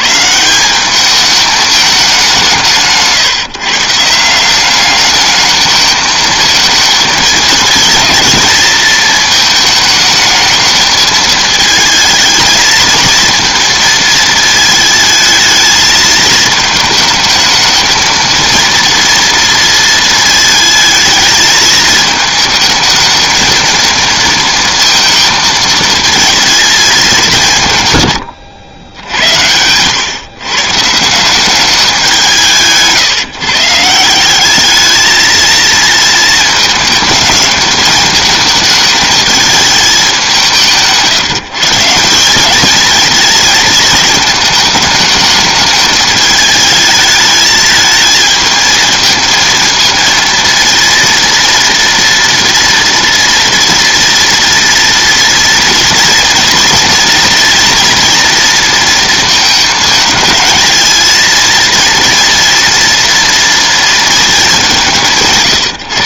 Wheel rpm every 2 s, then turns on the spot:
190, 160, 200, 220, 220, 220, 220, 220, 220, 230, 220, 220, 230, 210, 90, 150, 160, 210, 210, 220, 160, 220, 210, 220, 220, 230, 230, 230, 230, 230, 220, 240, 190.
none